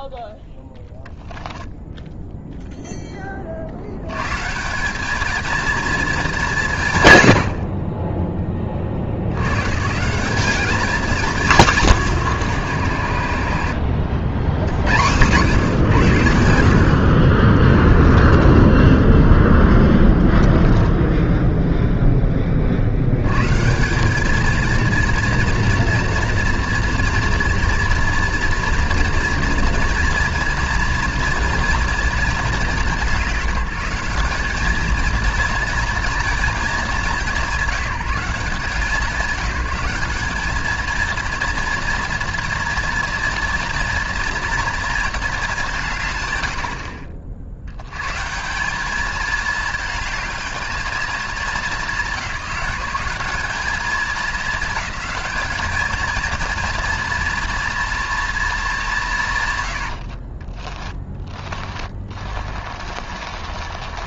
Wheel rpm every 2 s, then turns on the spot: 10, 10, 200, 140, 60, 200, 100, 80, 70, 10, 10, 60, 230, 240, 240, 230, 190, 230, 200, 180, 230, 230, 230, 60, 210, 220, 190, 210, 230, 200, 20, 40.
0-2 12-14 60-64